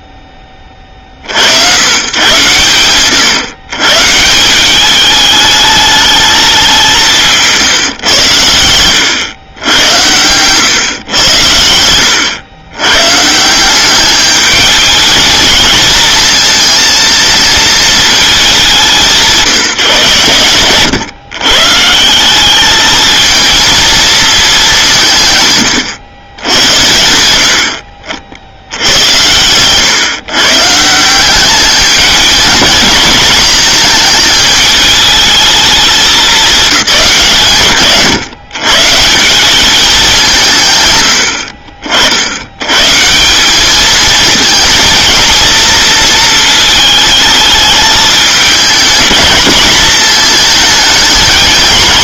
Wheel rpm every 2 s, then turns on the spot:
70, 130, 210, 160, 100, 90, 150, 220, 230, 180, 130, 220, 140, 80, 110, 180, 230, 220, 170, 170, 100, 160, 230, 220, 220, 230.
none